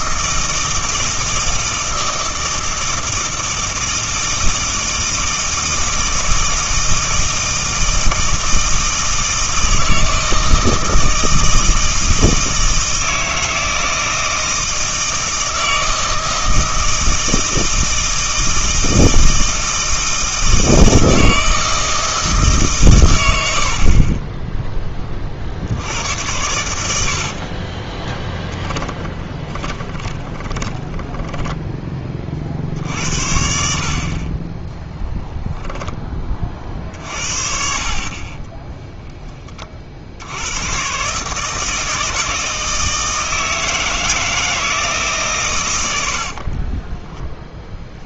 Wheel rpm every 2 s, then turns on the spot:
160, 160, 160, 160, 160, 160, 160, 160, 160, 160, 160, 140, 20, 90, 20, 20, 50, 10, 40, 10, 120, 160, 160, 20.
28-32 38-40 46-48